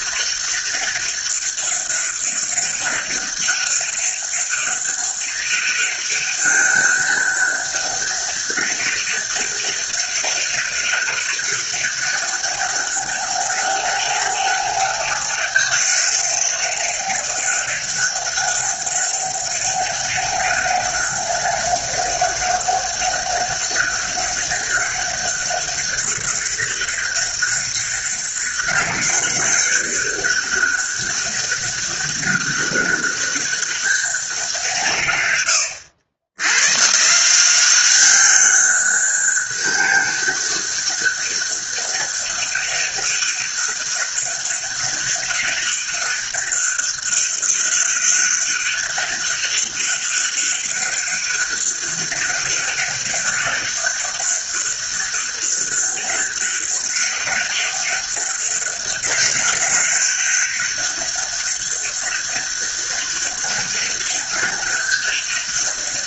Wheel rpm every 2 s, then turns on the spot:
200, 200, 200, 200, 200, 200, 200, 200, 200, 200, 200, 200, 200, 200, 200, 200, 200, 150, 140, 200, 200, 200, 200, 200, 200, 200, 200, 200, 200, 200, 200, 200, 200.
none